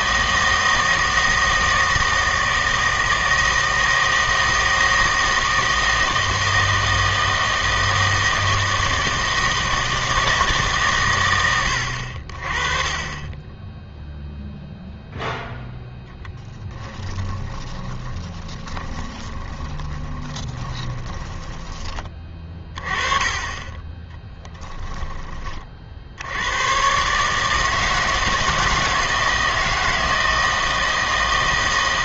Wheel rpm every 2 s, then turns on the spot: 160, 160, 160, 160, 160, 150, 30, 0, 10, 20, 20, 20, 10, 110, 160, 160.
16-22 24-26